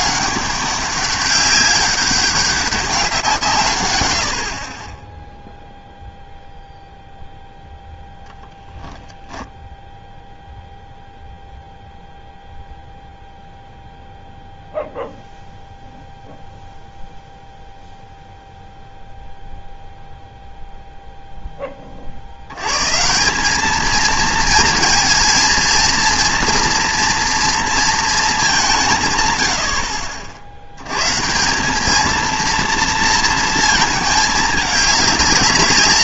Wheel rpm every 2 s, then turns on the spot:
200, 190, 30, 0, 0, 0, 0, 0, 0, 0, 0, 150, 230, 230, 160, 90, 230, 210.
none